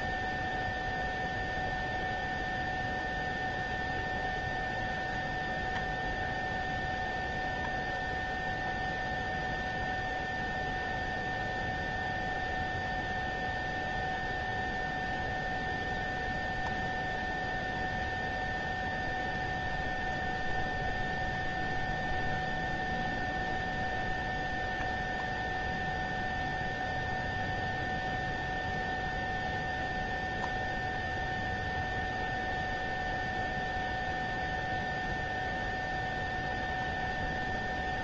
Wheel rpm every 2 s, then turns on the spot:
0, 0, 0, 0, 0, 0, 0, 0, 0, 0, 0, 0, 0, 0, 0, 0, 0, 0, 0.
none